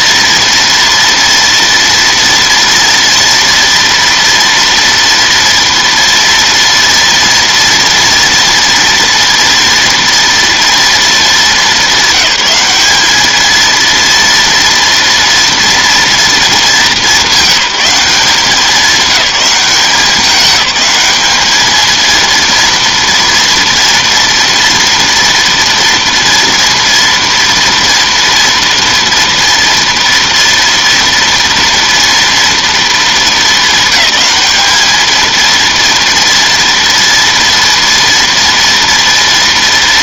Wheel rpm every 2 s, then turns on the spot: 230, 230, 240, 230, 230, 230, 200, 230, 210, 200, 200, 230, 230, 230, 230, 230, 230, 210, 230, 230.
none